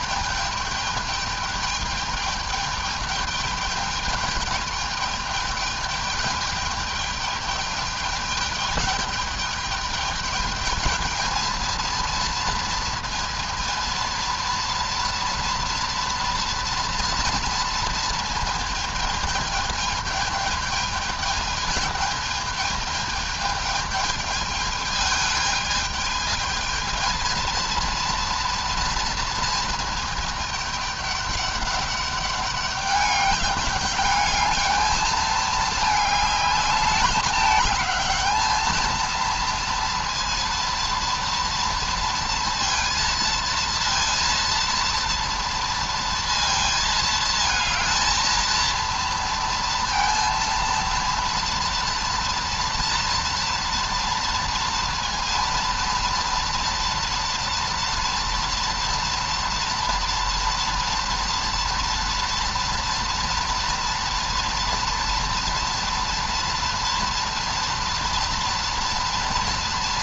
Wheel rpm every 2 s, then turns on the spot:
210, 210, 210, 210, 210, 210, 230, 230, 230, 220, 220, 220, 210, 220, 230, 220, 200, 210, 210, 220, 230, 230, 230, 230, 230, 230, 230, 230, 230, 230, 240, 230, 230, 230, 230.
none